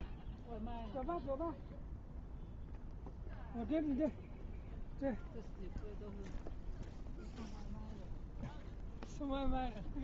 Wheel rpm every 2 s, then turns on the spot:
0, 0, 0, 0, 0.
none